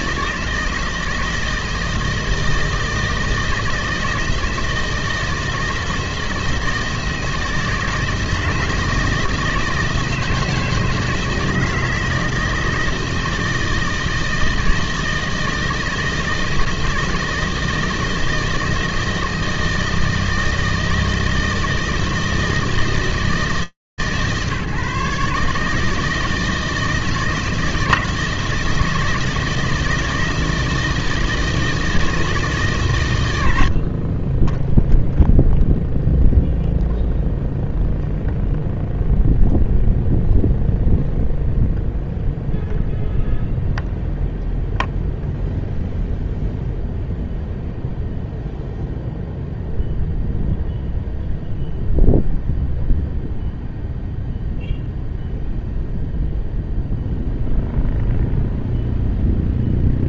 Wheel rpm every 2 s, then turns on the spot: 160, 160, 160, 170, 160, 160, 160, 160, 160, 160, 160, 160, 150, 160, 160, 160, 160, 30, 0, 0, 0, 0, 0, 0, 0, 0, 0, 0, 0, 0.
none